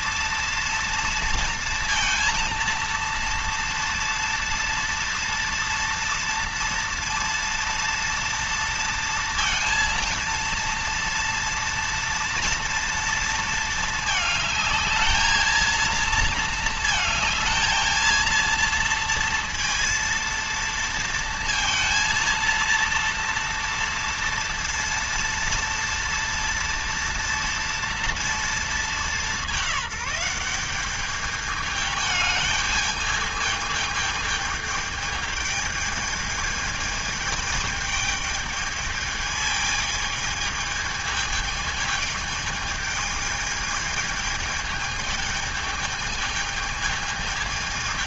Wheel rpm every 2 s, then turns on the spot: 230, 230, 230, 230, 230, 230, 230, 220, 230, 230, 230, 230, 230, 230, 230, 200, 210, 220, 210, 210, 220, 210, 220, 220.
none